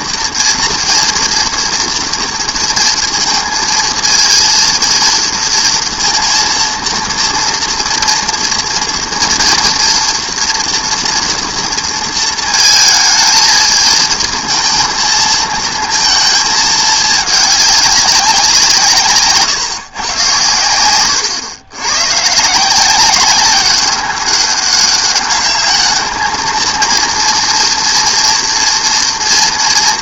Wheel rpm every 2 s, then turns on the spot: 230, 230, 230, 230, 230, 230, 220, 220, 220, 180, 110, 160, 200, 220, 230.
none